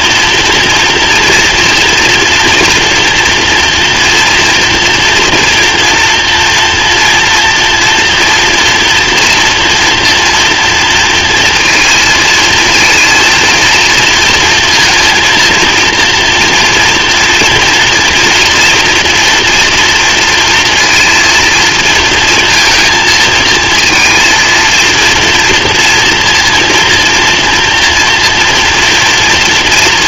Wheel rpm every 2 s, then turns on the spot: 240, 230, 230, 230, 230, 230, 230, 230, 230, 240, 230, 230, 230, 230, 230.
none